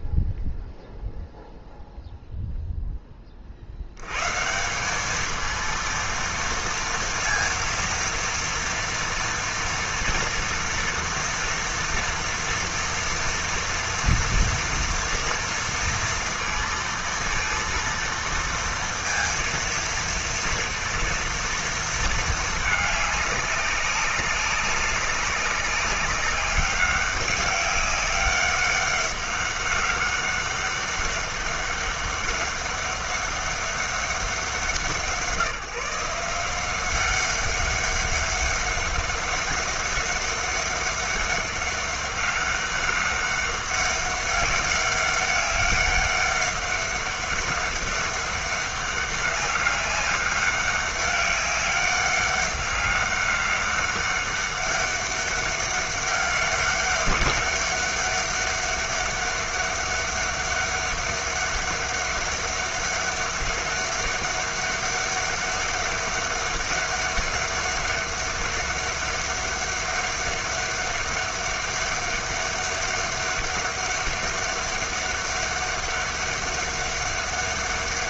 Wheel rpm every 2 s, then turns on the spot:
0, 0, 160, 230, 230, 230, 230, 230, 230, 230, 230, 220, 200, 200, 190, 200, 200, 190, 180, 200, 200, 200, 200, 200, 200, 200, 200, 200, 200, 200, 200, 200, 200, 200, 200, 200, 200, 200, 200.
none